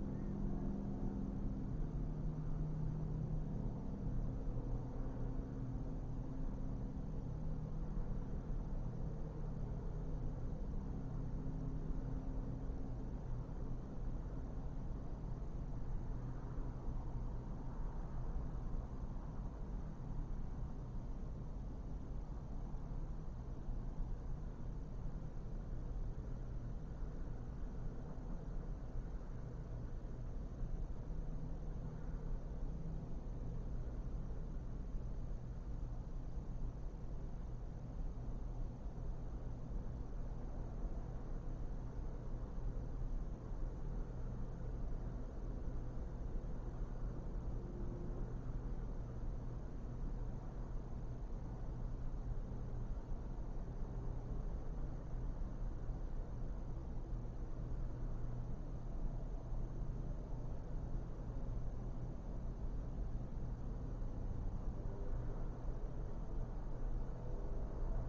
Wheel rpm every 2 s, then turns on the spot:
0, 0, 0, 0, 0, 0, 0, 0, 0, 0, 0, 0, 0, 0, 0, 0, 0, 0, 0, 0, 0, 0, 0, 0, 0, 0, 0, 0, 0, 0, 0, 0, 0, 0.
none